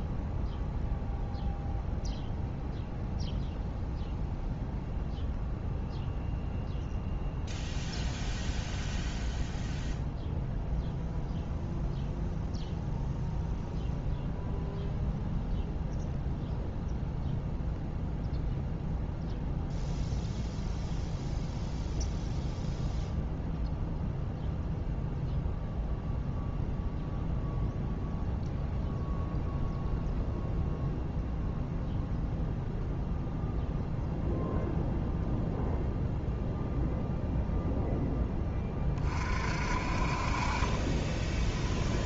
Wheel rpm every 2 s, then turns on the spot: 0, 0, 0, 0, 0, 0, 0, 0, 0, 0, 0, 0, 0, 0, 0, 0, 0, 0, 0, 20, 30.
40-42